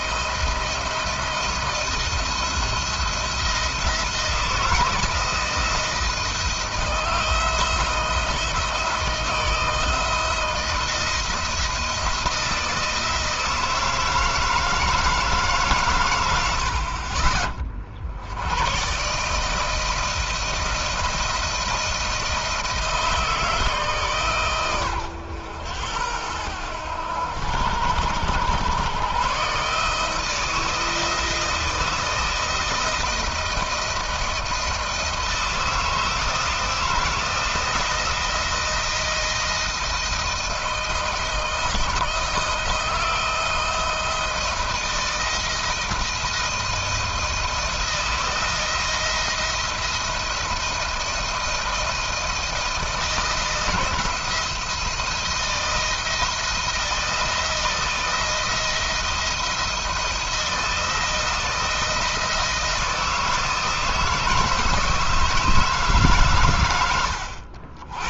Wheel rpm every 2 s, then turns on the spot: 160, 170, 160, 170, 170, 170, 160, 160, 100, 100, 160, 160, 130, 90, 100, 160, 160, 170, 160, 160, 160, 160, 170, 170, 170, 170, 160, 170, 160, 170, 170, 170, 160, 120.
none